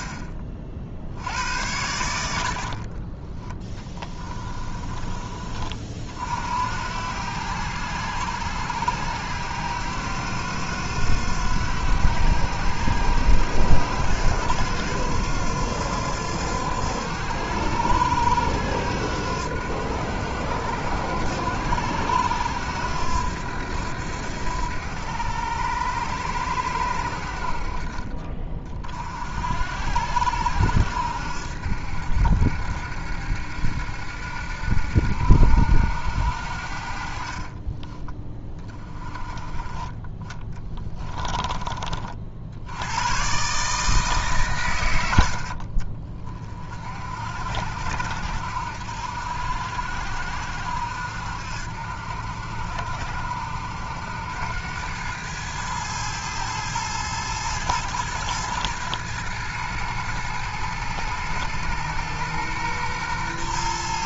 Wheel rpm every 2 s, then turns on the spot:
50, 50, 20, 80, 90, 90, 90, 90, 90, 90, 90, 90, 80, 80, 40, 70, 70, 70, 60, 20, 20, 80, 100, 50, 70, 70, 70, 100, 110, 110, 110, 120.
2-4 40-42